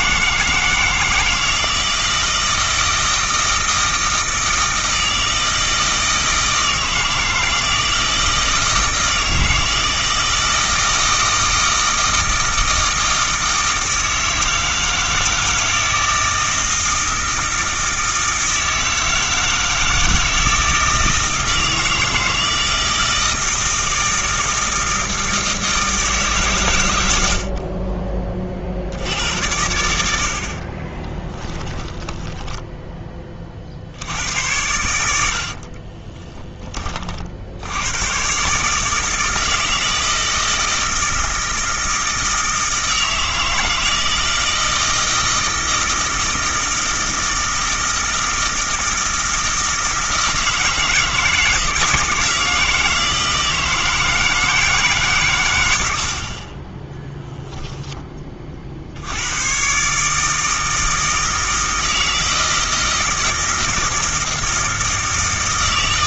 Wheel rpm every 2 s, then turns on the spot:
160, 160, 160, 160, 160, 160, 160, 160, 160, 160, 160, 160, 160, 110, 60, 50, 20, 90, 20, 150, 160, 160, 160, 160, 160, 160, 160, 150, 20, 50, 160, 160, 160.
30-34